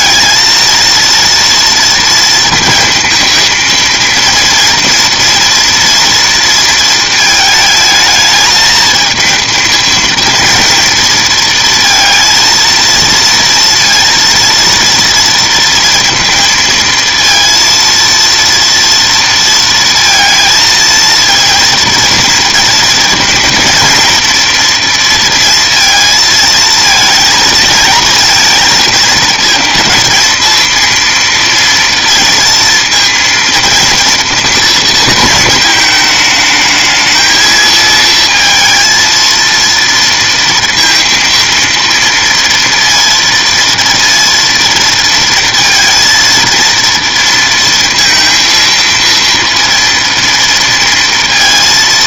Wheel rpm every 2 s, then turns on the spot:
230, 230, 230, 230, 220, 230, 230, 230, 230, 230, 230, 230, 230, 220, 230, 230, 230, 230, 220, 230, 230, 230, 230, 230, 230, 230.
none